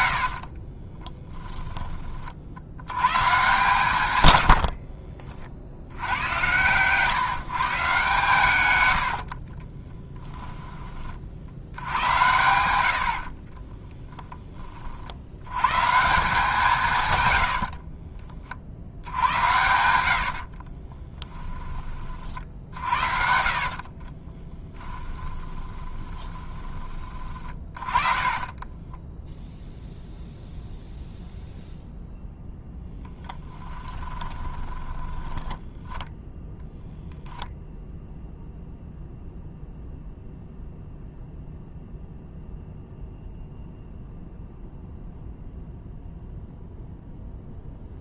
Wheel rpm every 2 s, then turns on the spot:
60, 80, 80, 110, 110, 30, 90, 30, 160, 60, 40, 70, 20, 20, 30, 0, 10, 20, 0, 0, 0, 0, 0, 0.
0-2 4-6 8-10 20-22 24-30 34-36